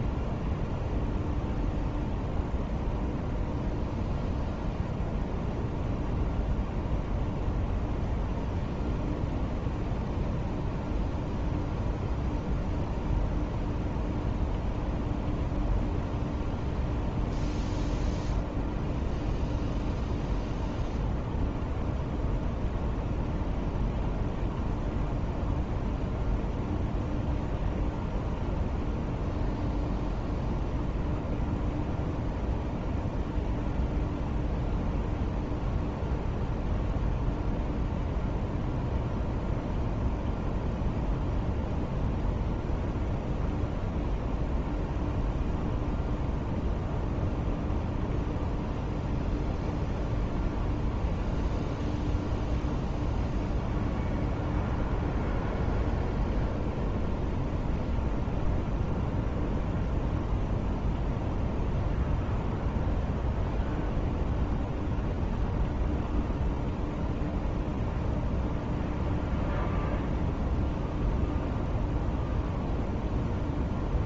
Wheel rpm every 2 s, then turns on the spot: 0, 0, 0, 0, 0, 0, 0, 0, 0, 0, 0, 0, 0, 0, 0, 0, 0, 0, 0, 0, 0, 0, 0, 0, 0, 0, 0, 0, 0, 0, 0, 0, 0, 0, 0, 0, 0.
none